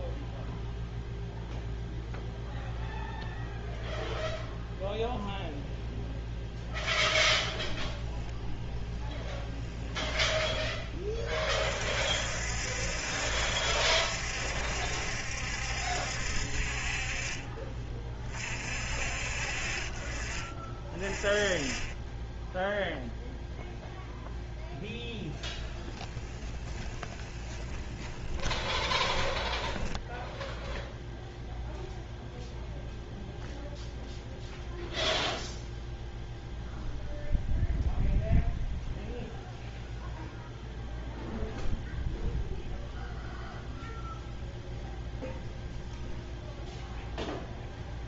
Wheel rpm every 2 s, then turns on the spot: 0, 0, 0, 0, 0, 10, 60, 70, 50, 50, 30, 0, 10, 20, 20, 0, 0, 0, 0, 0, 0, 0, 0, 0.
26-30